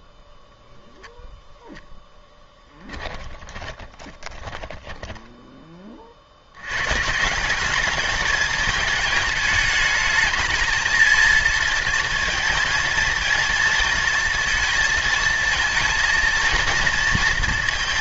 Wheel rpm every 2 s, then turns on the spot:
0, 10, 10, 130, 220, 220, 230, 230, 230.
2-6